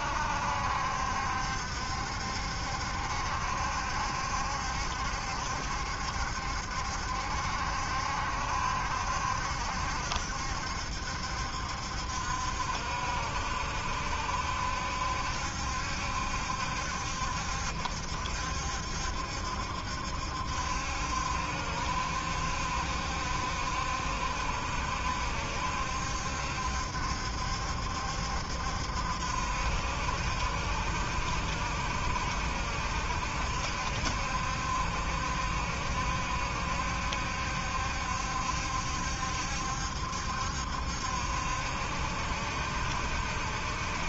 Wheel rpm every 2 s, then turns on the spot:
70, 70, 70, 70, 70, 70, 70, 70, 70, 70, 70, 70, 70, 70, 70, 70, 70, 70, 70, 70, 70, 70.
none